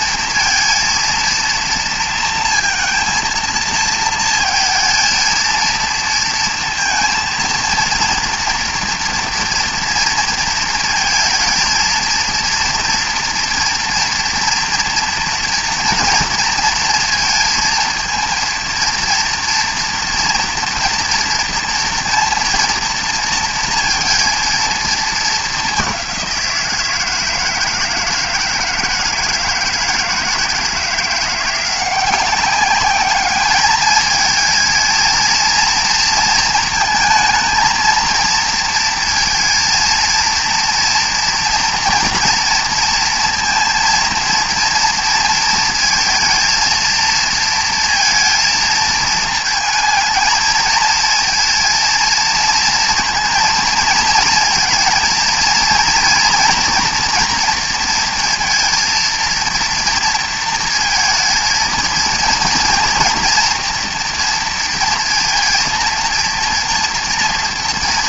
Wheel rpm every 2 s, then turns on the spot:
230, 230, 220, 230, 230, 220, 230, 230, 230, 230, 230, 230, 220, 160, 160, 170, 200, 230, 230, 230, 240, 230, 230, 230, 220, 220, 230, 230, 230, 230, 230, 230, 230, 230.
none